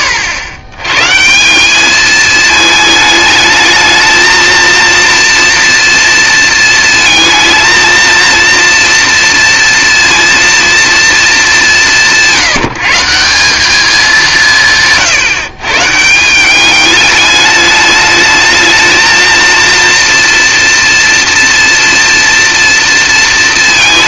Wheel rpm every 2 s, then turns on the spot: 100, 210, 230, 230, 230, 230, 160, 160, 210, 220, 230, 230.
none